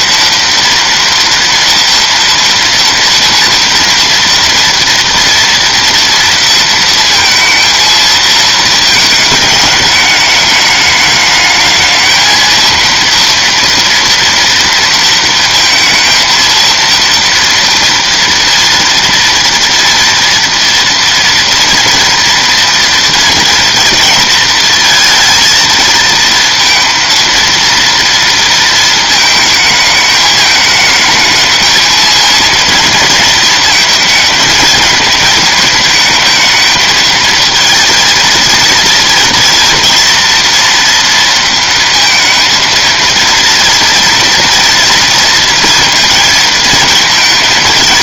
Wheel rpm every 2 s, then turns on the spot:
230, 230, 230, 230, 220, 210, 230, 230, 230, 230, 230, 230, 220, 230, 230, 220, 220, 220, 220, 230, 230, 230, 230, 220.
none